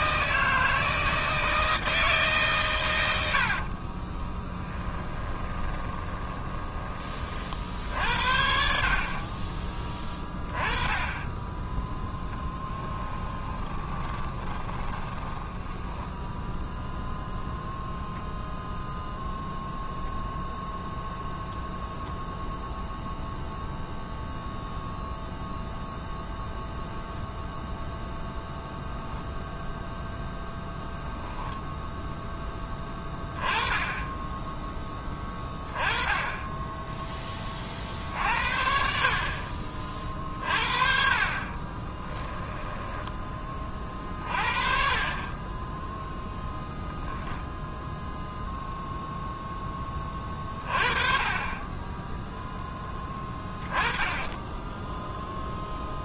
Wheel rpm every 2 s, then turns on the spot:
160, 110, 20, 30, 50, 20, 10, 20, 0, 0, 0, 0, 0, 0, 0, 0, 20, 10, 10, 50, 40, 10, 30, 10, 0, 30, 10, 0.
4-6 12-16 42-44 46-48